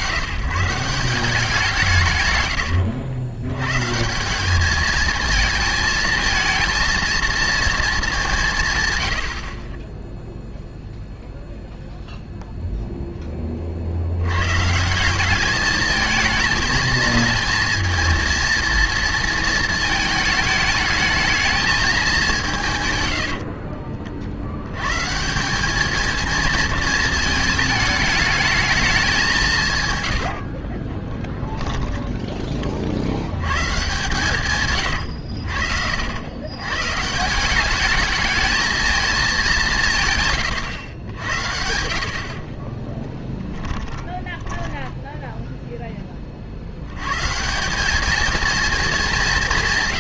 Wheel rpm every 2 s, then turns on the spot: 160, 80, 220, 220, 120, 0, 0, 160, 230, 230, 220, 120, 110, 220, 210, 30, 50, 120, 120, 220, 110, 20, 10, 90, 220.
2-4 30-32 42-46